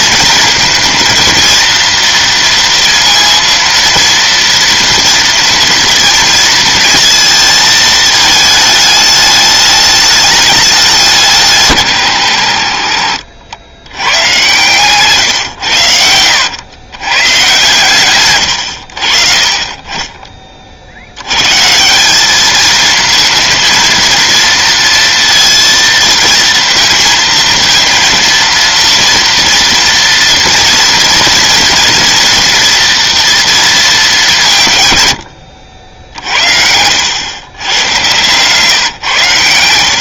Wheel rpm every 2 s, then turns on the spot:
230, 230, 230, 230, 220, 210, 110, 120, 100, 110, 40, 210, 230, 230, 230, 230, 240, 180, 60, 130.
none